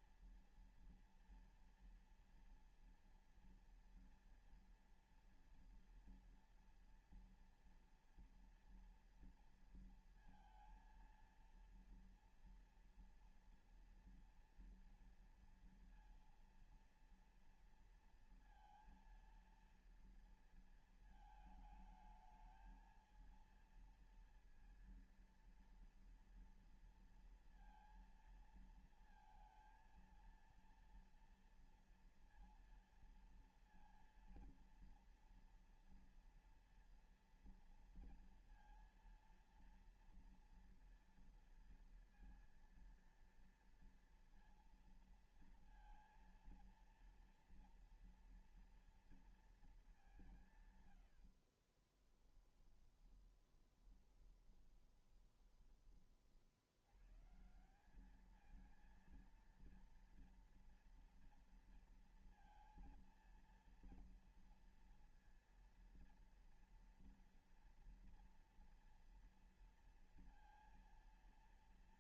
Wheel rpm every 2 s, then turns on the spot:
230, 230, 230, 230, 230, 230, 240, 230, 230, 230, 230, 220, 230, 230, 230, 230, 230, 230, 240, 230, 230, 230, 230, 230, 230, 140, 10, 10, 70, 220, 230, 230, 230, 230, 230, 230.
50-56